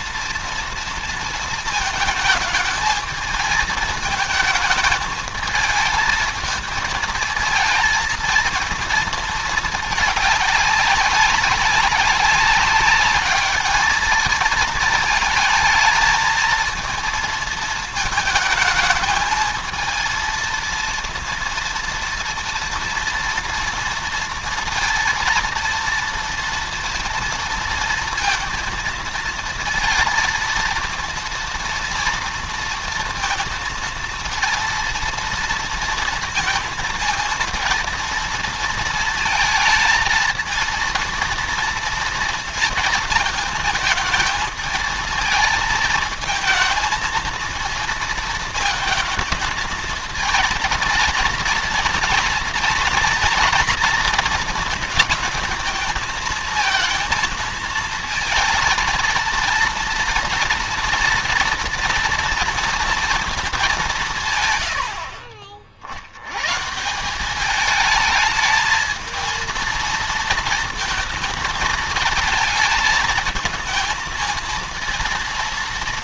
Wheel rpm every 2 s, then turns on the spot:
230, 220, 220, 220, 230, 210, 200, 220, 220, 220, 230, 230, 230, 240, 230, 230, 230, 230, 230, 230, 230, 230, 220, 220, 230, 230, 240, 230, 220, 220, 230, 230, 110, 120, 220, 230, 220, 230.
none